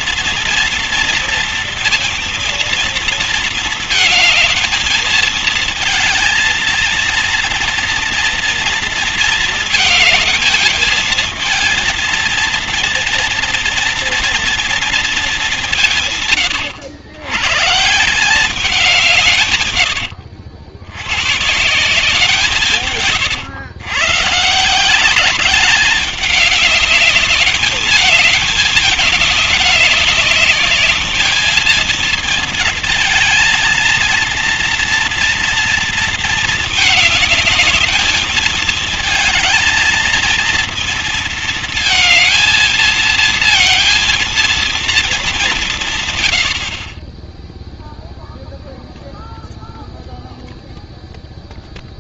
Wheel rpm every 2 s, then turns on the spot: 230, 230, 220, 230, 230, 220, 240, 230, 110, 180, 120, 130, 170, 200, 210, 210, 230, 230, 220, 220, 230, 220, 220, 40, 0, 0.
none